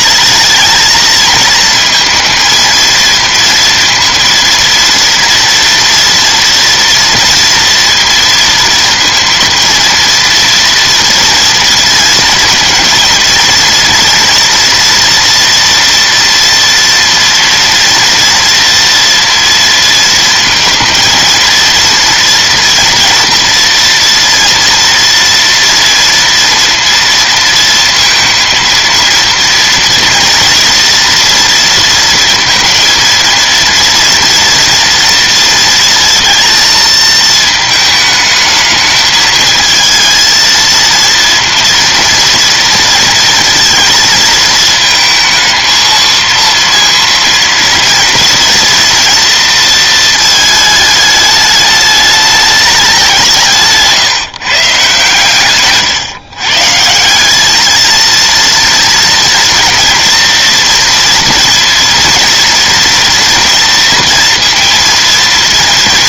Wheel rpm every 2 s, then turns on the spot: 220, 230, 230, 230, 230, 230, 230, 230, 240, 230, 230, 230, 230, 230, 230, 230, 230, 230, 220, 220, 230, 230, 220, 230, 230, 220, 200, 150, 150, 230, 230, 240, 230.
none